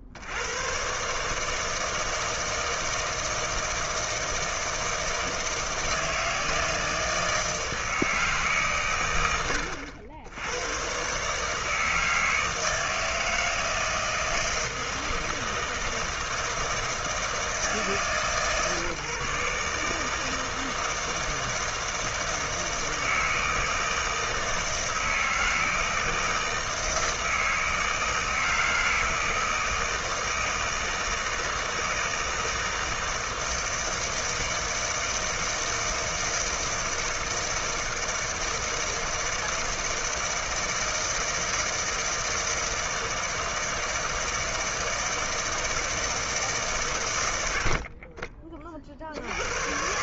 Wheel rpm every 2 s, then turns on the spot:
110, 160, 160, 160, 140, 100, 160, 160, 160, 150, 160, 160, 160, 160, 160, 160, 160, 160, 160, 160, 160, 160, 160, 150, 30.
none